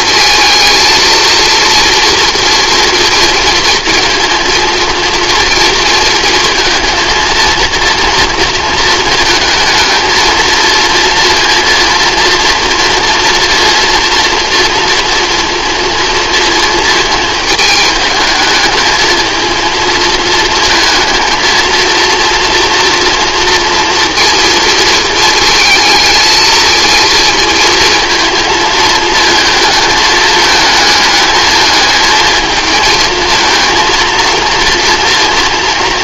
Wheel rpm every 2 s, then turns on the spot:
230, 240, 230, 230, 230, 230, 230, 240, 230, 220, 230, 230, 230, 230, 220, 220, 230, 230.
none